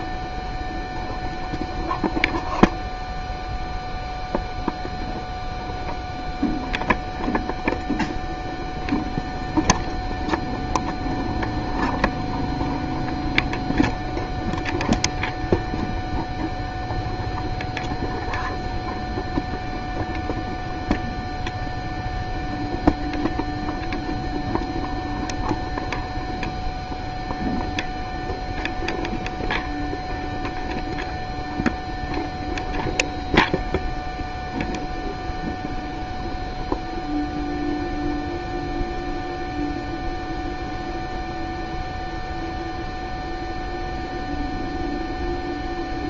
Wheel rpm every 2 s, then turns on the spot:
0, 0, 0, 0, 0, 0, 0, 0, 0, 0, 0, 0, 0, 0, 0, 0, 0, 0, 0, 0, 0, 0, 0.
none